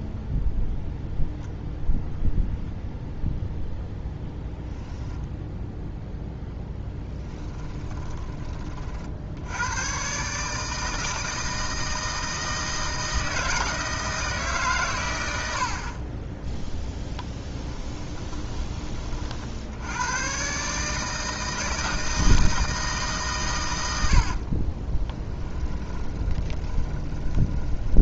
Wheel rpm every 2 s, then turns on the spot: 0, 0, 0, 10, 30, 150, 160, 150, 10, 10, 130, 160, 30, 20.
16-18 24-28